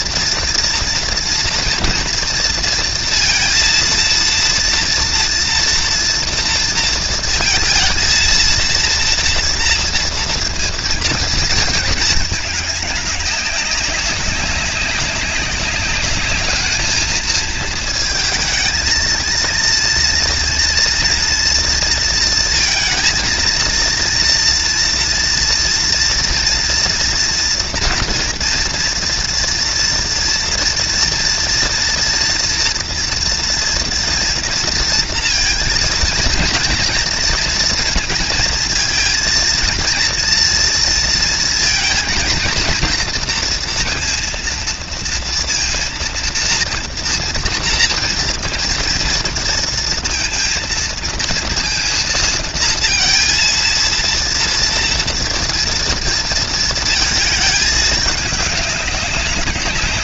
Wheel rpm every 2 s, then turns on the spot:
230, 230, 230, 230, 230, 230, 200, 190, 220, 230, 230, 220, 230, 230, 230, 230, 240, 230, 230, 230, 230, 230, 230, 230, 230, 230, 230, 230, 220, 200.
none